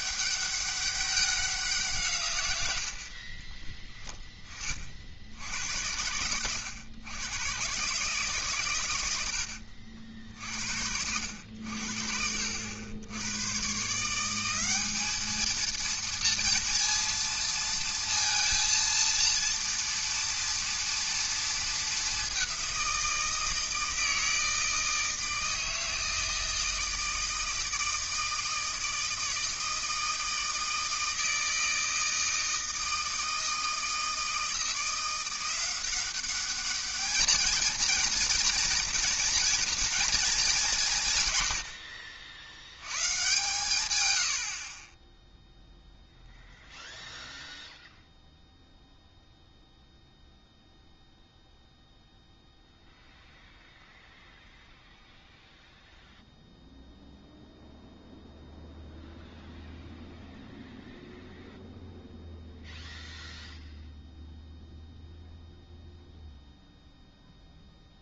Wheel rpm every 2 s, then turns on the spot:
200, 100, 30, 120, 120, 70, 80, 190, 230, 230, 230, 190, 160, 160, 160, 160, 160, 170, 210, 230, 180, 90, 50, 0, 0, 0, 0, 0, 0, 0, 0, 0, 0, 0.
44-46